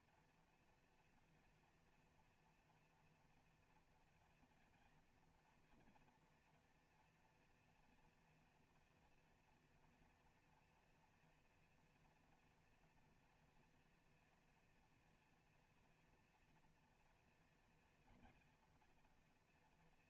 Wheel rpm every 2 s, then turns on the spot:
230, 230, 230, 230, 230, 230, 230, 230, 240, 240.
none